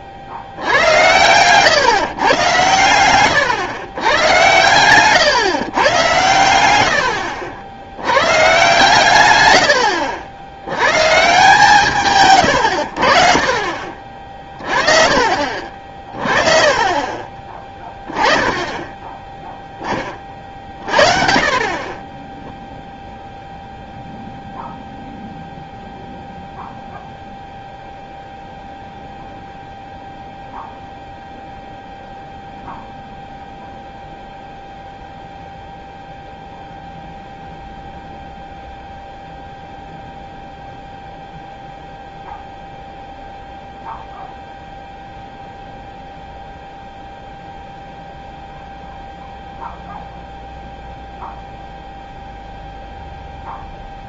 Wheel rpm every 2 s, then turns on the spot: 90, 120, 120, 90, 150, 80, 110, 40, 30, 10, 30, 0, 0, 0, 0, 0, 0, 0, 0, 0, 0, 0, 0, 0, 0, 0, 0.
0-2